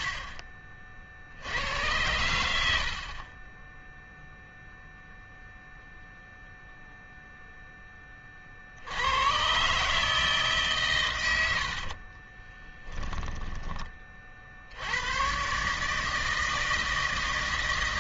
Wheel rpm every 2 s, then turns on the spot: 50, 60, 0, 0, 70, 140, 20, 80, 160.
12-14